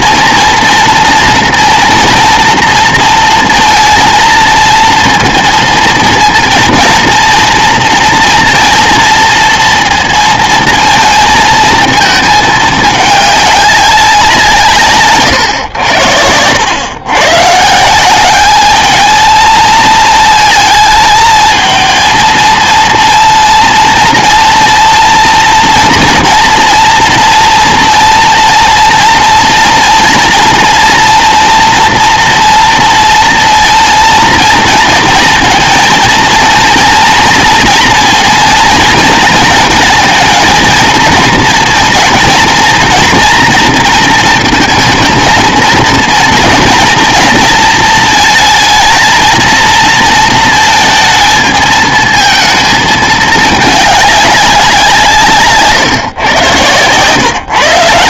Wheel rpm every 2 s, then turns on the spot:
230, 230, 230, 230, 230, 230, 210, 160, 110, 210, 220, 230, 240, 230, 230, 230, 230, 230, 240, 230, 230, 230, 220, 230, 220, 220, 220, 180, 120.
none